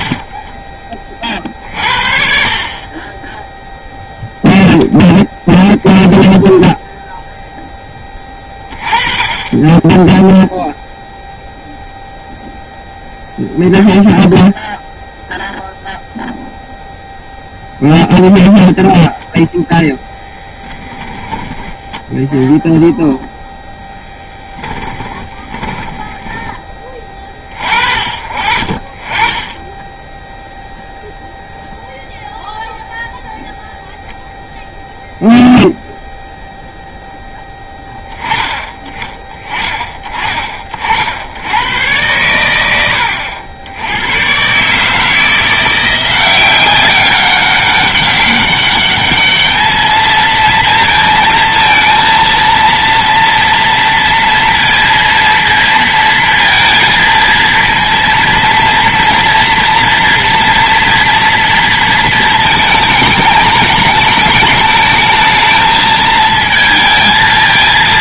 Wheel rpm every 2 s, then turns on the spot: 10, 40, 0, 0, 20, 0, 0, 0, 0, 0, 10, 0, 10, 20, 40, 0, 0, 0, 0, 30, 40, 90, 150, 190, 200, 230, 230, 230, 230, 230, 230, 220, 210, 220.
24-26